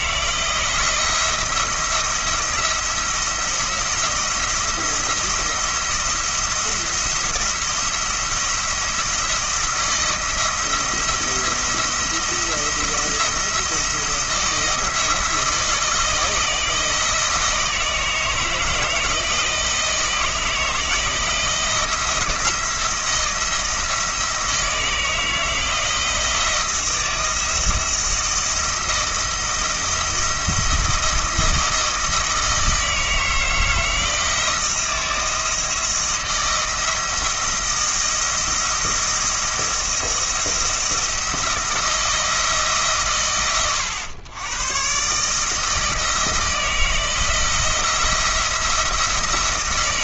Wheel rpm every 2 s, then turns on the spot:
170, 170, 170, 170, 170, 170, 170, 160, 160, 160, 160, 170, 160, 170, 160, 160, 160, 160, 170, 170, 170, 150, 120, 160, 170.
none